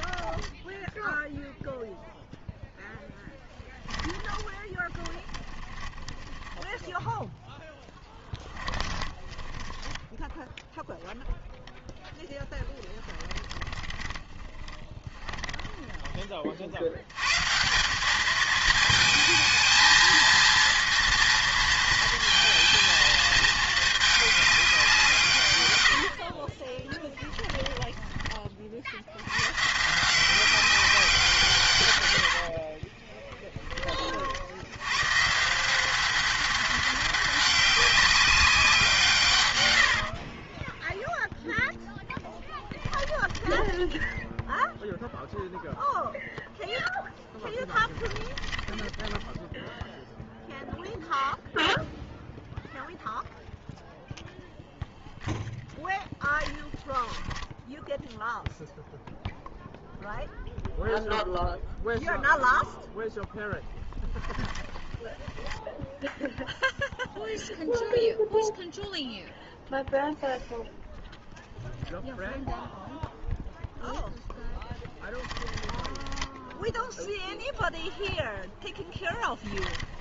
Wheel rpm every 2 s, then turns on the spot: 10, 0, 20, 10, 20, 0, 10, 20, 50, 220, 230, 230, 200, 30, 40, 190, 40, 80, 190, 190, 20, 10, 0, 0, 10, 0, 0, 0, 20, 0, 0, 0, 20, 0, 0, 0, 0, 10, 0, 10.
4-10 12-16 26-28 32-34 40-44 48-50 56-58 64-66 74-76